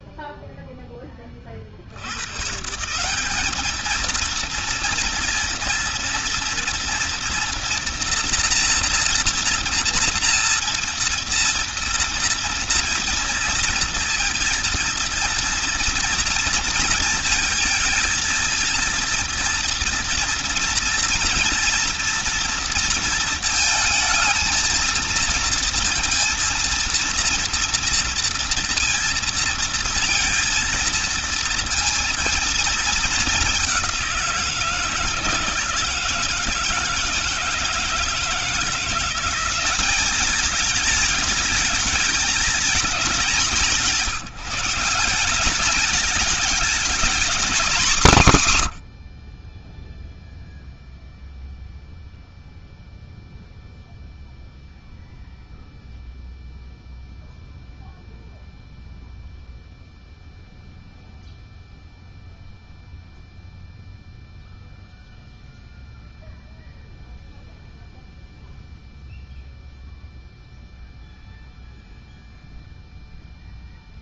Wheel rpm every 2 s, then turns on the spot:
20, 190, 230, 230, 230, 230, 230, 230, 220, 230, 230, 230, 230, 230, 230, 220, 220, 160, 160, 180, 210, 210, 190, 230, 70, 0, 0, 0, 0, 0, 0, 0, 0, 0, 0, 0, 0.
none